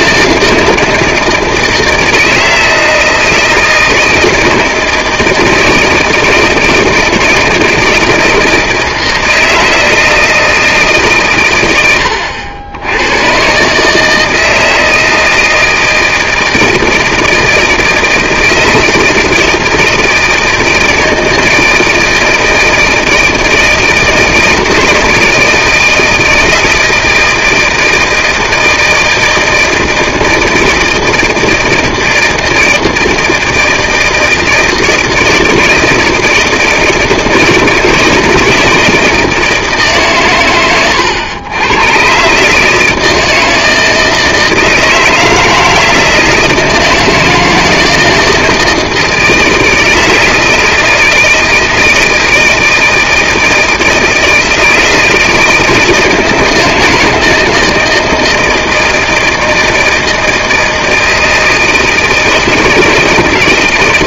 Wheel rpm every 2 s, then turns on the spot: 160, 160, 160, 170, 160, 160, 90, 160, 160, 160, 160, 160, 160, 160, 160, 160, 160, 160, 160, 160, 110, 150, 160, 160, 160, 160, 160, 160, 160, 160, 160, 160.
none